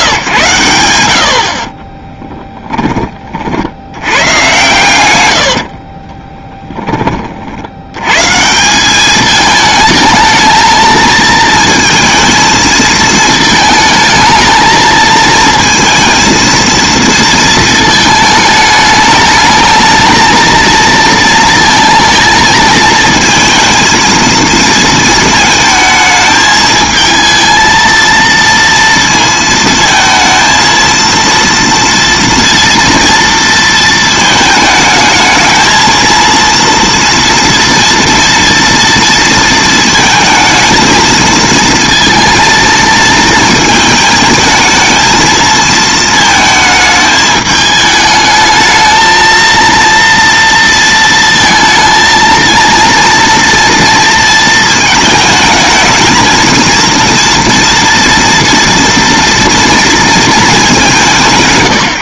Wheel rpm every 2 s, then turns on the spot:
110, 20, 120, 10, 170, 220, 220, 220, 230, 210, 230, 220, 230, 220, 230, 230, 230, 220, 230, 230, 220, 230, 220, 220, 220, 230, 230, 220, 230, 230, 180.
none